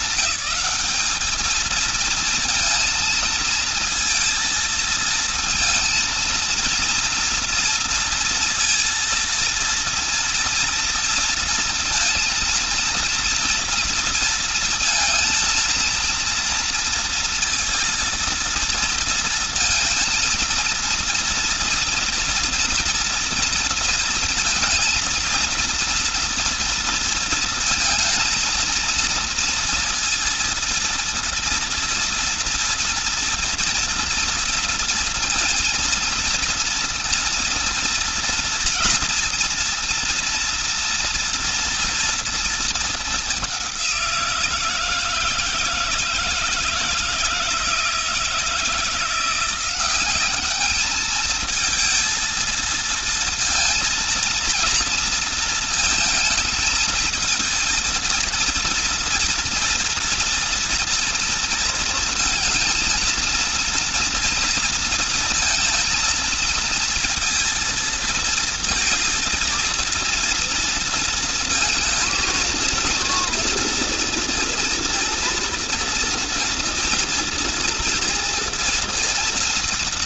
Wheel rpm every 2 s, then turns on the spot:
210, 230, 230, 230, 230, 230, 230, 230, 230, 230, 230, 230, 230, 230, 230, 230, 230, 230, 230, 230, 230, 230, 170, 160, 160, 200, 230, 230, 230, 230, 240, 230, 230, 230, 230, 230, 230, 230, 230, 230.
none